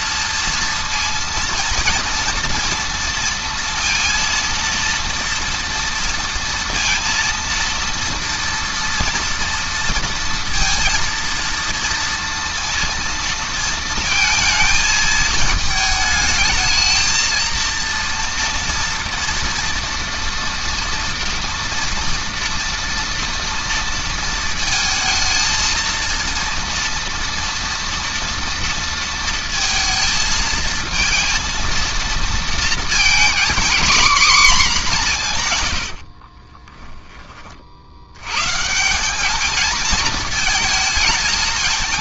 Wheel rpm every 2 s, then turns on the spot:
230, 230, 230, 230, 230, 230, 230, 220, 220, 230, 230, 230, 220, 230, 230, 230, 230, 200, 20, 190, 220.
none